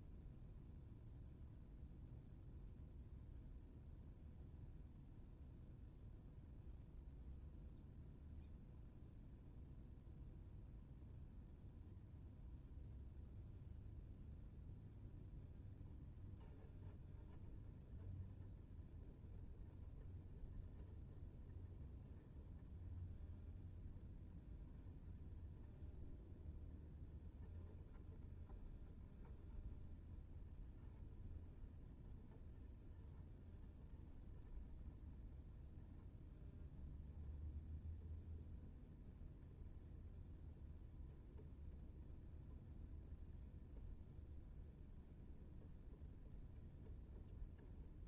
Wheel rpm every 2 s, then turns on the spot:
0, 0, 0, 0, 0, 0, 0, 0, 0, 0, 0, 0, 0, 0, 0, 0, 0, 0, 0, 0, 0, 0, 0, 0.
none